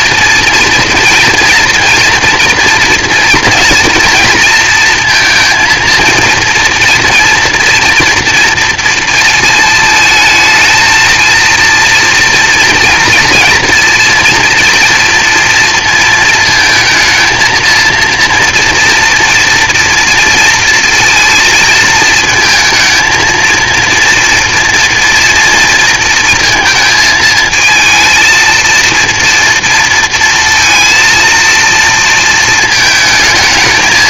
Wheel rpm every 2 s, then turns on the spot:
230, 240, 230, 230, 230, 220, 230, 230, 230, 230, 230, 220, 240, 220, 230, 230, 220.
none